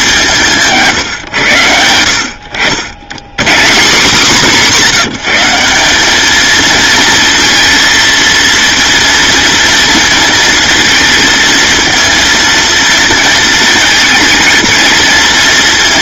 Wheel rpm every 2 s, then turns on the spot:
150, 90, 150, 230, 230, 230, 230, 230.
none